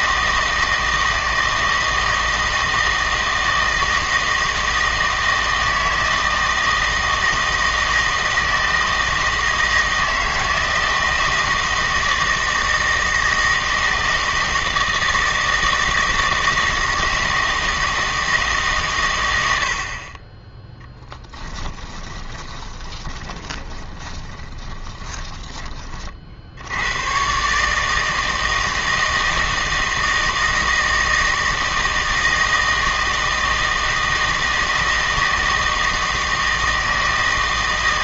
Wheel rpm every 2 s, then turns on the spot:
160, 160, 160, 160, 160, 160, 160, 160, 160, 150, 20, 20, 20, 70, 160, 160, 160, 160, 160.
22-26